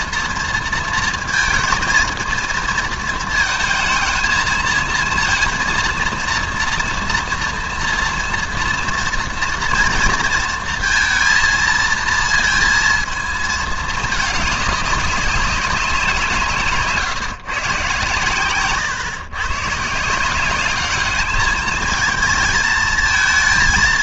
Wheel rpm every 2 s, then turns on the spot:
230, 230, 230, 230, 230, 230, 230, 200, 140, 130, 200, 220.
none